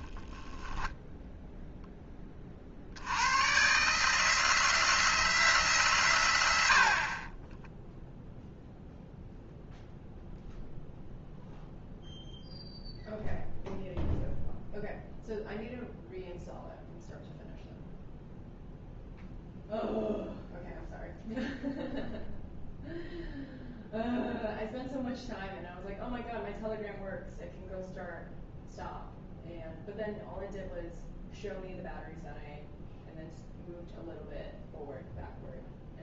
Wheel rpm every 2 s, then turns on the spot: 10, 50, 160, 80, 0, 0, 0, 0, 0, 0, 0, 0, 0, 0, 0, 0, 0, 0.
none